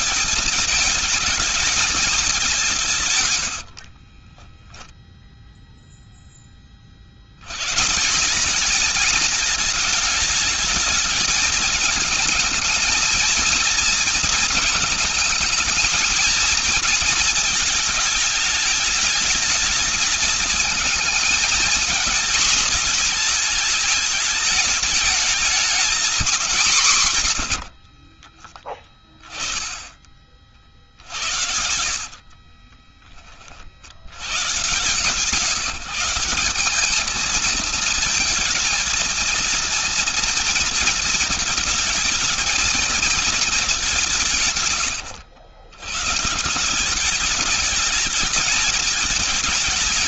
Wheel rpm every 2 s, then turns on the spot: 220, 200, 20, 20, 190, 220, 220, 220, 230, 210, 220, 220, 220, 200, 40, 30, 40, 110, 190, 230, 230, 220, 150, 140, 210.
4-6 28-30 32-34